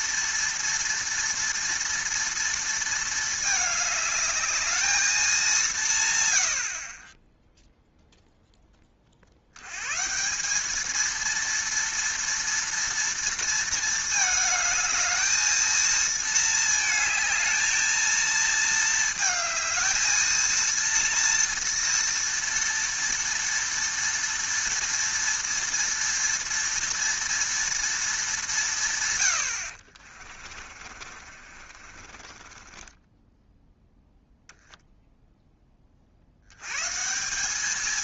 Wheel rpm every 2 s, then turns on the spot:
240, 230, 210, 70, 10, 200, 230, 220, 220, 220, 230, 230, 230, 230, 170, 40, 20, 0, 100.
30-34